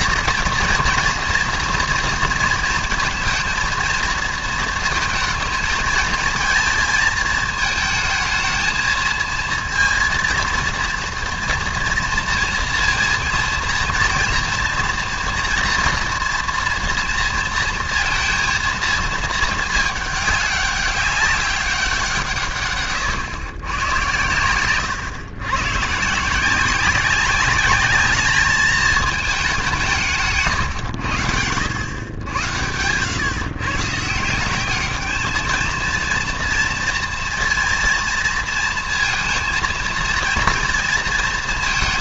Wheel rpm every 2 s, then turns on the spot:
230, 230, 220, 220, 220, 230, 230, 230, 230, 230, 200, 140, 120, 180, 220, 140, 100, 190, 230, 230, 230.
none